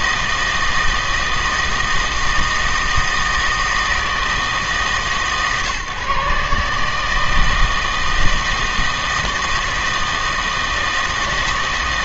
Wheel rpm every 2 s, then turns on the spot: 160, 160, 150, 150, 160, 160.
none